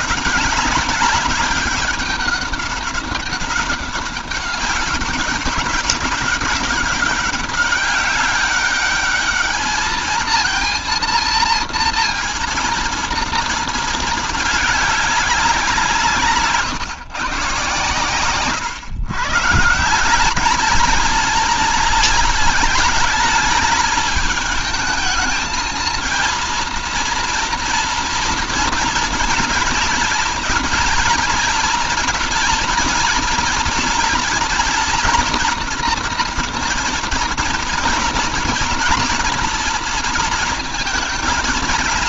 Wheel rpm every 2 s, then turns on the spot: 200, 200, 200, 190, 200, 230, 230, 210, 140, 120, 220, 220, 210, 230, 230, 230, 230, 240, 230, 230, 220.
none